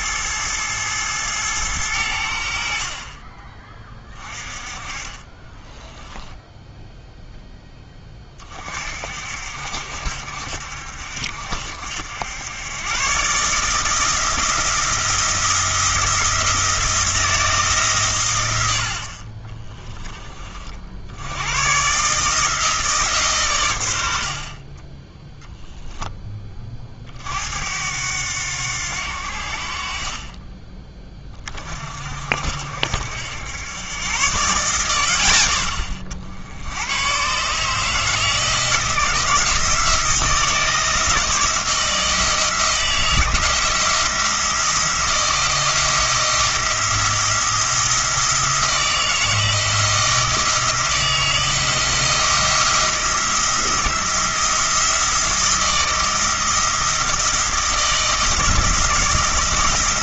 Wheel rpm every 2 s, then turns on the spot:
110, 50, 20, 0, 40, 70, 120, 170, 170, 60, 60, 160, 20, 30, 80, 20, 70, 90, 100, 160, 160, 170, 170, 170, 160, 170, 170, 170, 160, 160.
none